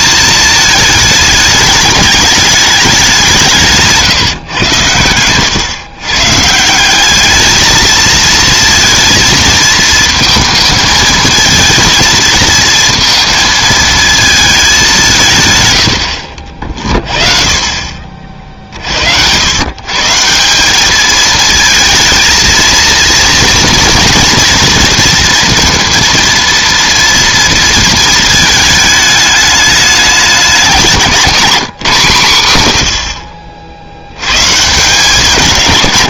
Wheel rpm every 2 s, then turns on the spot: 220, 210, 120, 160, 230, 220, 230, 210, 50, 50, 180, 230, 230, 240, 220, 190, 120, 160.
none